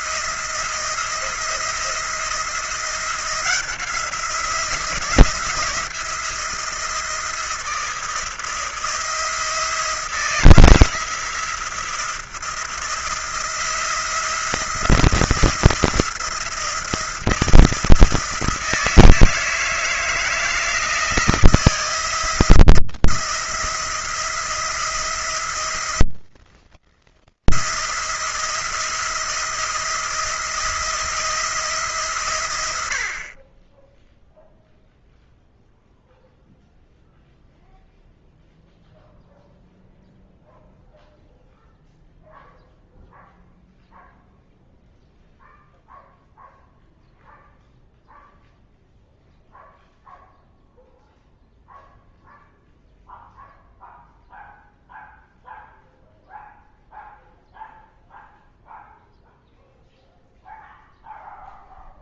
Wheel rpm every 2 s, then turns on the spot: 170, 170, 170, 170, 160, 170, 170, 170, 170, 160, 160, 170, 170, 170, 170, 170, 70, 0, 0, 0, 0, 0, 0, 0, 0, 0, 0, 0, 0, 0, 0.
none